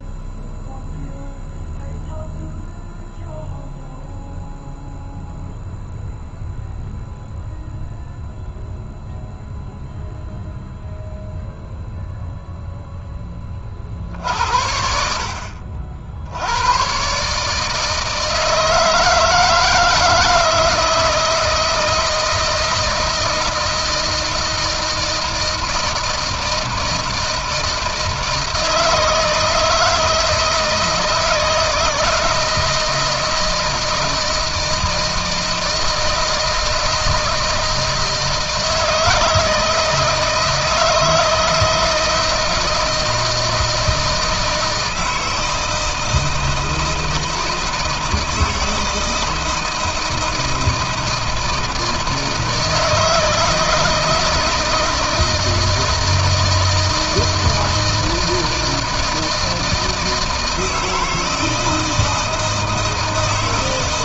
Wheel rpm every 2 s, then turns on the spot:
0, 0, 0, 0, 0, 0, 0, 60, 100, 160, 160, 170, 160, 160, 160, 160, 160, 160, 160, 160, 160, 160, 160, 160, 160, 160, 160, 160, 160, 160, 160, 160.
none